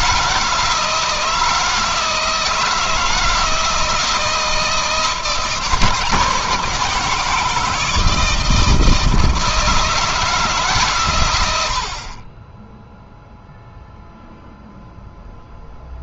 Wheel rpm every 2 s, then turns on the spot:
160, 160, 170, 170, 160, 130, 0, 0.
none